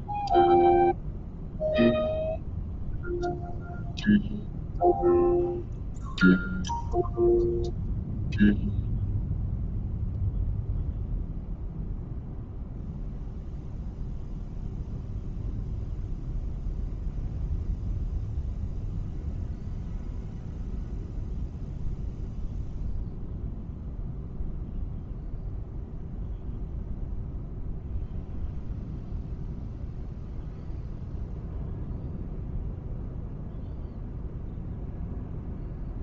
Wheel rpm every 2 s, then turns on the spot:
0, 0, 0, 0, 0, 0, 0, 0, 0, 0, 0, 0, 0, 0, 0, 0, 0, 0.
none